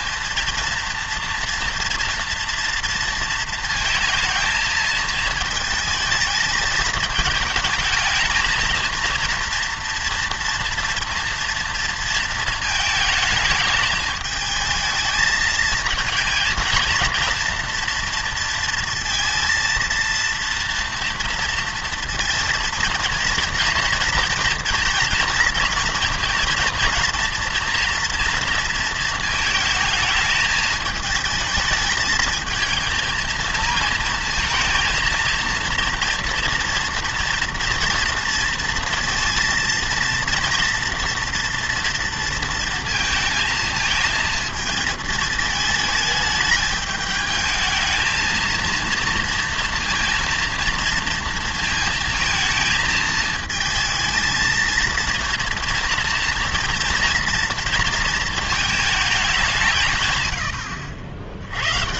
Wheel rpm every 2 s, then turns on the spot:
230, 230, 220, 220, 230, 230, 220, 220, 230, 230, 230, 230, 230, 230, 230, 220, 220, 230, 230, 230, 230, 230, 220, 210, 230, 230, 220, 230, 240, 220, 80.
none